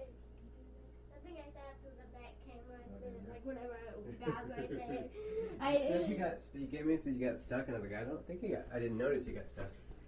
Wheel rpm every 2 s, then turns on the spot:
0, 0, 0, 0, 0.
none